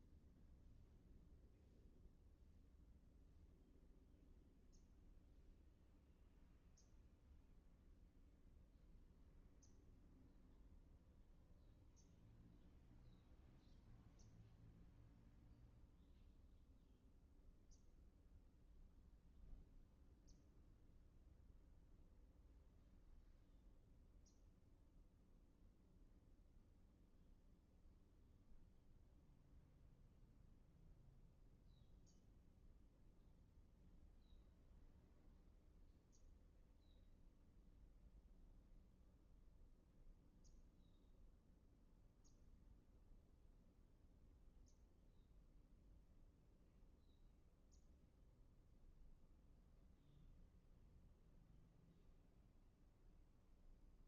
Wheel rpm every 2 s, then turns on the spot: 0, 0, 0, 0, 0, 0, 0, 0, 0, 0, 0, 0, 0, 0, 0, 0, 0, 0, 0, 0, 0, 0, 0, 0, 0, 0, 0.
none